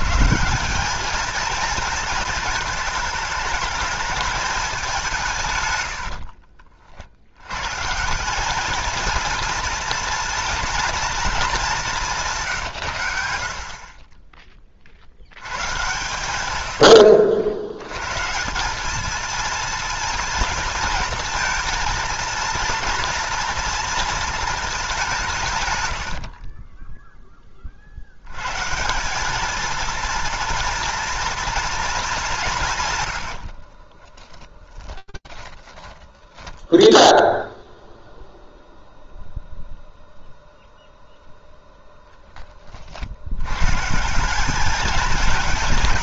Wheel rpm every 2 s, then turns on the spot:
200, 220, 210, 70, 210, 230, 110, 30, 90, 200, 230, 230, 210, 30, 150, 240, 150, 20, 10, 0, 0, 40, 210.
26-28 34-36